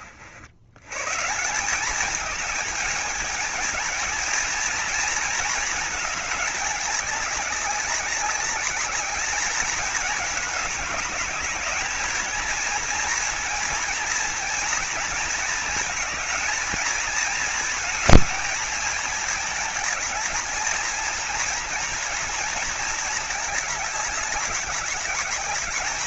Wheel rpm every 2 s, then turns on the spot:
130, 220, 220, 210, 200, 210, 230, 230, 230, 220, 230, 220, 210.
none